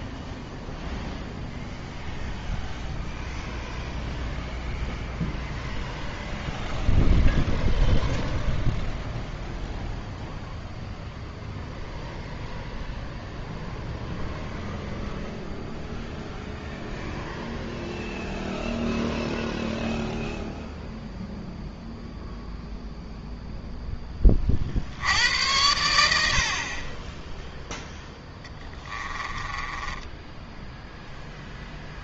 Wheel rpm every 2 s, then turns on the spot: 0, 0, 0, 0, 0, 0, 0, 0, 0, 0, 0, 0, 40, 40, 20, 0.
28-30